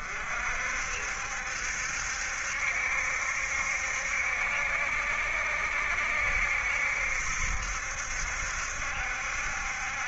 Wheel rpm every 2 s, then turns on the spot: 60, 70, 70, 70, 70.
none